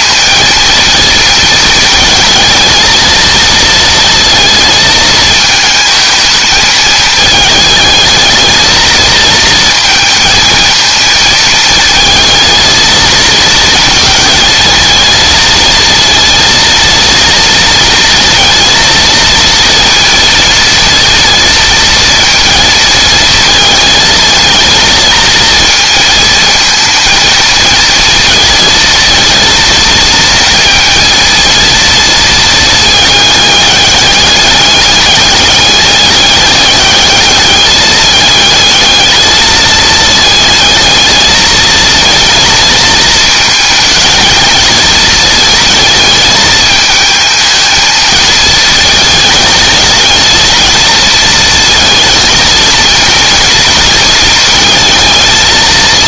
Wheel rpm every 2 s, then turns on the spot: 220, 220, 220, 220, 220, 220, 230, 230, 230, 230, 230, 230, 220, 230, 230, 230, 220, 200, 210, 220, 220, 220, 220, 220, 220, 230, 230, 220.
none